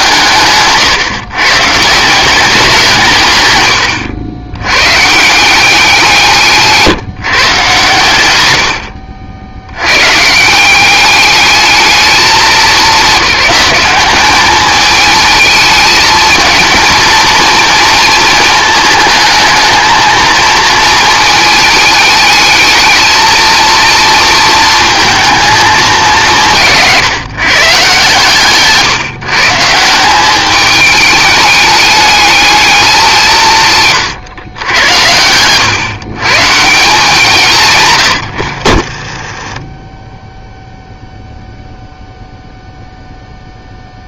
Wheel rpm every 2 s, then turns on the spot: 150, 190, 120, 160, 70, 160, 210, 210, 220, 220, 220, 210, 230, 160, 140, 200, 210, 110, 160, 60, 0, 0.
38-40